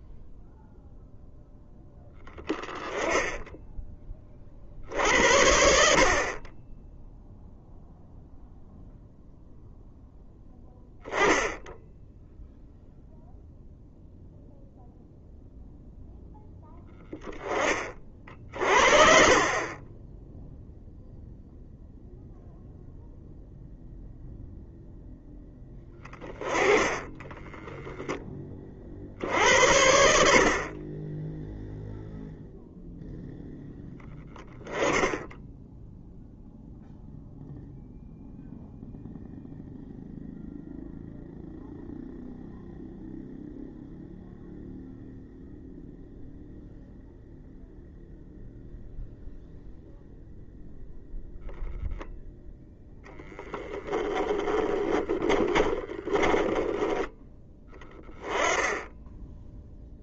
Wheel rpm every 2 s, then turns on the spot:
0, 10, 60, 20, 0, 10, 0, 0, 0, 50, 0, 0, 0, 20, 50, 20, 0, 20, 0, 0, 0, 0, 0, 0, 0, 0, 0, 20, 10, 10.
54-56